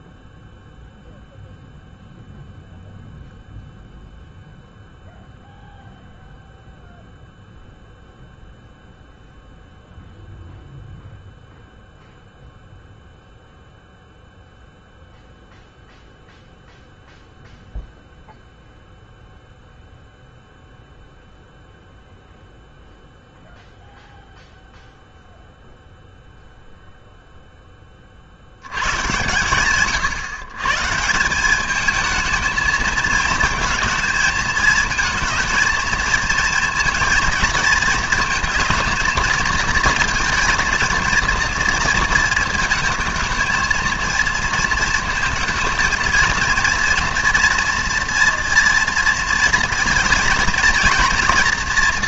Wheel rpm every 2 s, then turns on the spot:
0, 0, 0, 0, 0, 0, 0, 0, 0, 0, 0, 0, 0, 0, 80, 130, 220, 220, 230, 220, 220, 220, 230, 230, 230, 230.
none